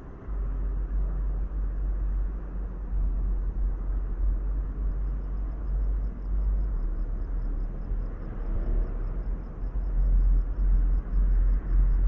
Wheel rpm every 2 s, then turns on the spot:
0, 0, 0, 0, 0, 0.
none